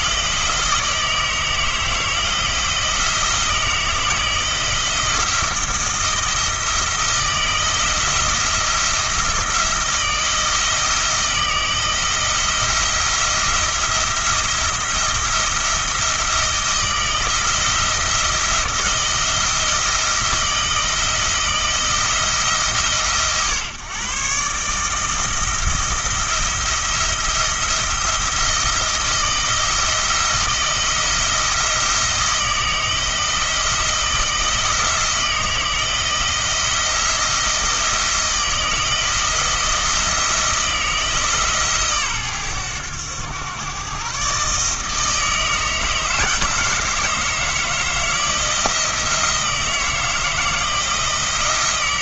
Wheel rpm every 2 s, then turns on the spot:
160, 160, 160, 170, 170, 160, 170, 170, 170, 160, 160, 150, 150, 170, 170, 170, 160, 160, 170, 170, 160, 110, 150, 160, 170, 170.
none